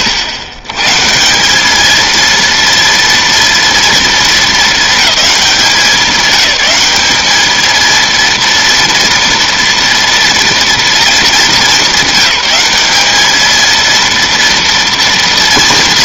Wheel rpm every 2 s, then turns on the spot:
90, 230, 220, 200, 230, 230, 210, 240.
none